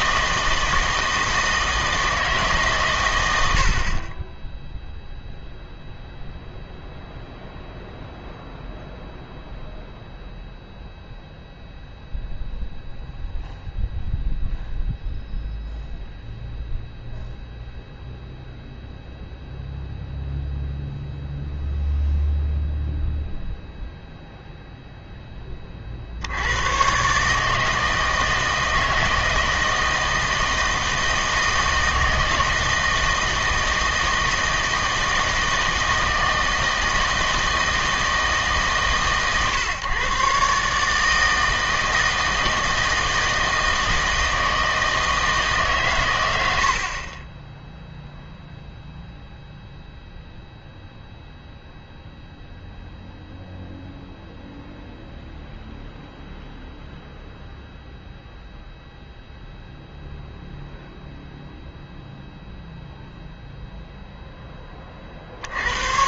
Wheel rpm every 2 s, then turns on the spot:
160, 140, 0, 0, 0, 0, 0, 0, 0, 0, 0, 0, 0, 110, 160, 160, 160, 160, 160, 150, 140, 160, 160, 80, 0, 0, 0, 0, 0, 0, 0, 0, 20.
none